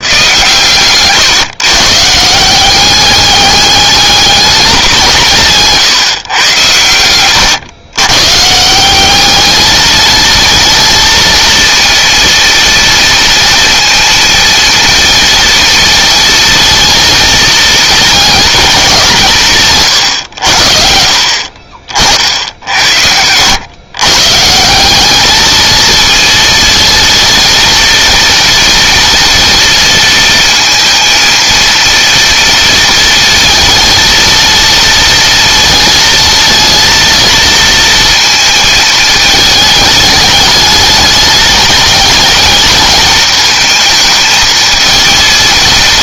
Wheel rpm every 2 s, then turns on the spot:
130, 190, 200, 110, 190, 230, 230, 230, 230, 180, 50, 80, 190, 230, 230, 230, 230, 230, 230, 220, 210, 220, 230.
none